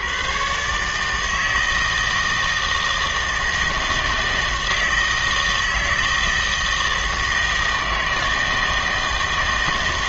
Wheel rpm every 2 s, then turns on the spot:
130, 160, 160, 160, 160.
none